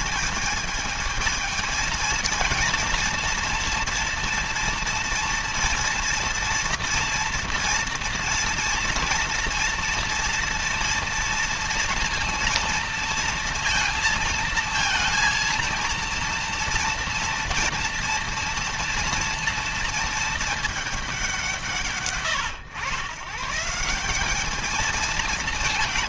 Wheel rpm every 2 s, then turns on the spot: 220, 230, 230, 230, 230, 230, 230, 230, 230, 230, 220, 130, 210.
none